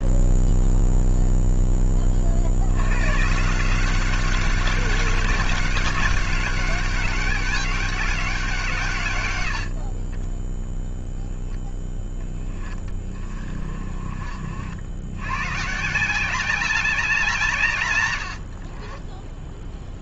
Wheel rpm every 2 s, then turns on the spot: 0, 110, 190, 200, 130, 0, 20, 90, 190, 30.
none